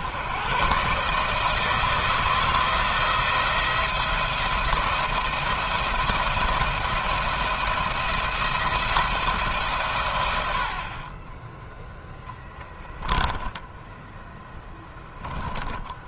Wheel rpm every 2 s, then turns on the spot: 130, 170, 170, 170, 170, 60, 20, 20.
12-14